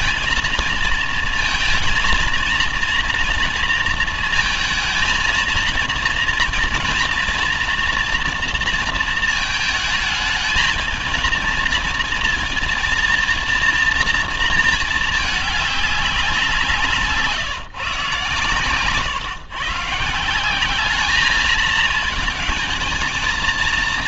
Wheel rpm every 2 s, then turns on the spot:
230, 230, 230, 230, 230, 220, 230, 230, 180, 140, 180, 220.
none